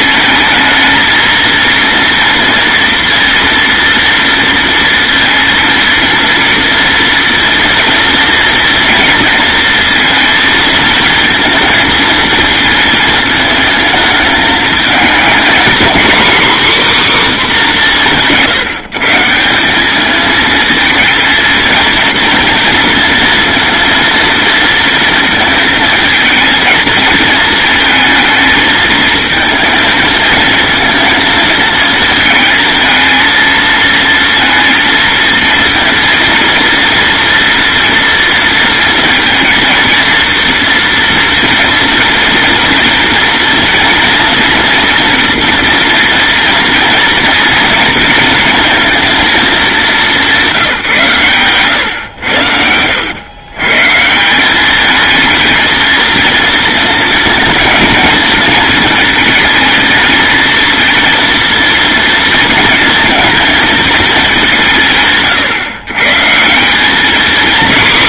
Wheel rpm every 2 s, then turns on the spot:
220, 230, 230, 230, 230, 230, 220, 220, 270, 160, 220, 240, 230, 230, 220, 230, 230, 230, 230, 230, 230, 230, 230, 240, 240, 160, 100, 210, 220, 220, 230, 230, 160, 210.
none